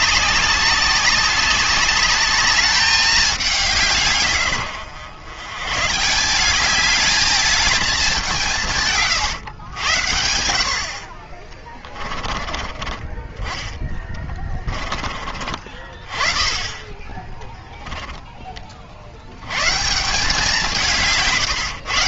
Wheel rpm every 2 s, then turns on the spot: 190, 210, 110, 200, 150, 60, 20, 20, 20, 40, 170.
none